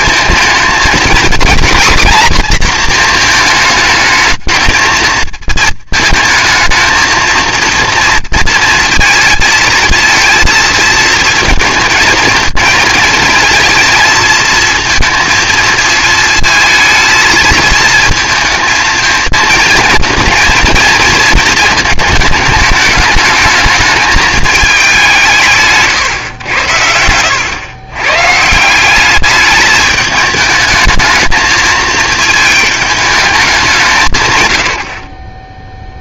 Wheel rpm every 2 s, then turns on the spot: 220, 230, 220, 220, 230, 230, 230, 230, 220, 220, 230, 220, 210, 80, 180, 220, 220, 90.
none